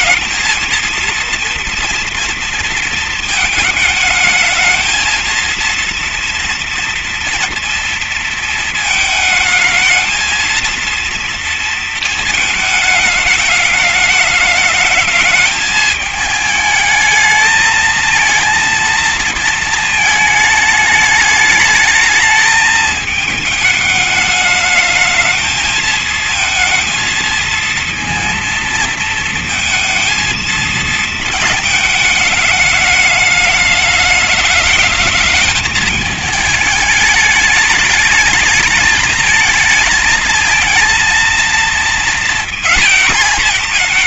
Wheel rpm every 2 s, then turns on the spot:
230, 220, 230, 230, 220, 230, 210, 220, 220, 230, 210, 220, 220, 220, 230, 220, 210, 220, 220, 220, 230, 230.
none